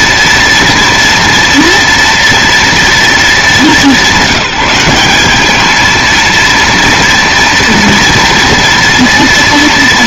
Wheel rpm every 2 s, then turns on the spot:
230, 230, 190, 230, 230.
none